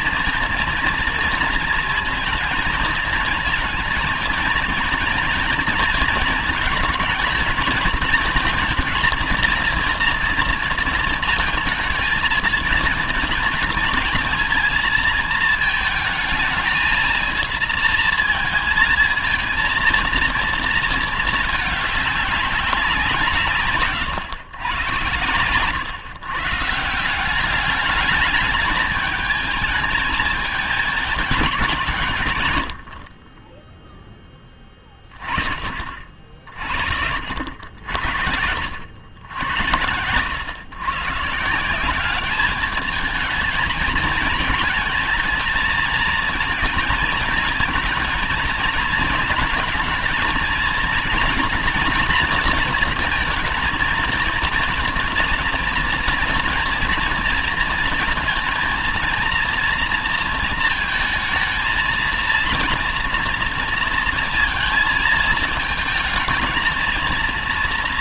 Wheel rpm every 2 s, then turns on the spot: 230, 230, 230, 220, 230, 230, 220, 230, 220, 230, 230, 200, 120, 130, 210, 220, 120, 20, 40, 70, 110, 210, 220, 220, 230, 230, 230, 230, 230, 220, 230, 230, 230, 230.
none